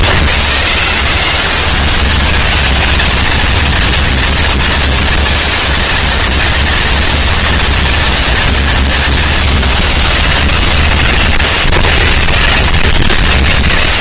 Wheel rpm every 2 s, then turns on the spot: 110, 210, 230, 230, 230, 180, 90.
none